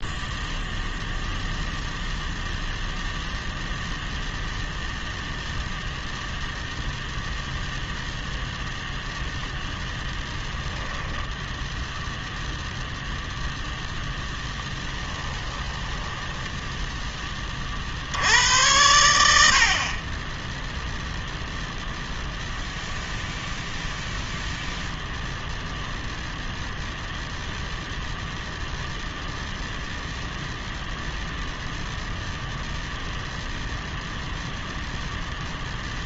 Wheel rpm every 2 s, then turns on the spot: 0, 0, 0, 0, 0, 10, 0, 10, 10, 90, 0, 0, 0, 0, 0, 0, 0, 0.
10-12 14-16